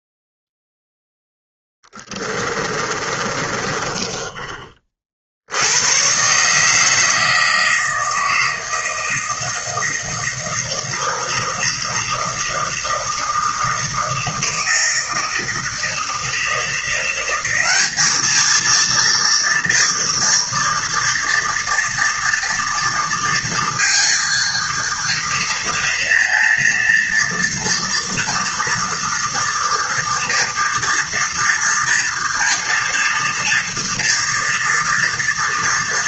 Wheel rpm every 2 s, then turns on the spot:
0, 20, 30, 140, 160, 160, 160, 160, 160, 220, 230, 230, 230, 230, 230, 230, 230, 230.
2-4